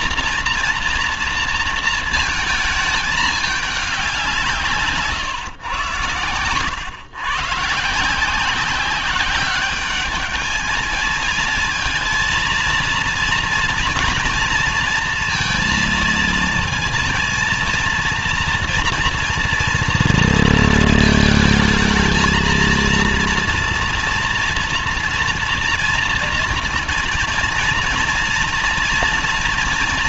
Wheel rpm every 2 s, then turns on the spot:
230, 220, 160, 100, 180, 210, 230, 230, 230, 240, 230, 220, 230, 230, 240.
none